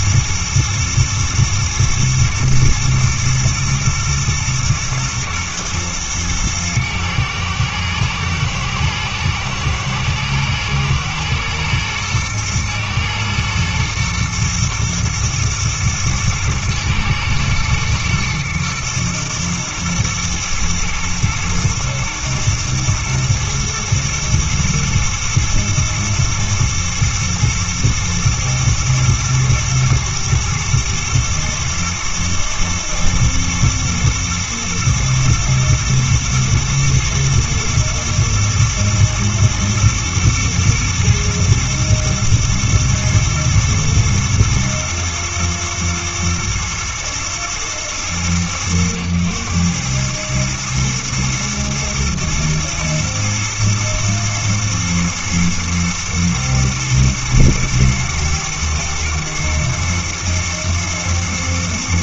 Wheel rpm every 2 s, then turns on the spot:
110, 120, 120, 110, 110, 110, 120, 120, 120, 110, 110, 120, 110, 120, 120, 110, 120, 120, 110, 110, 120, 110, 120, 120, 100, 110, 110, 110, 120, 110, 120.
none